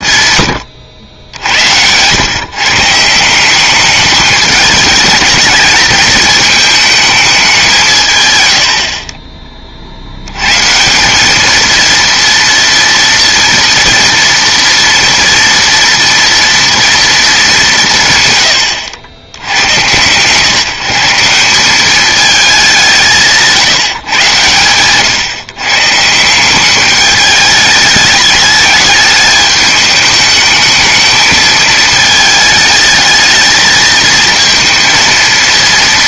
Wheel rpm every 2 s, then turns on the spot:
120, 150, 210, 210, 100, 130, 230, 230, 230, 110, 150, 200, 110, 190, 210, 220, 220, 230.
0-2 8-10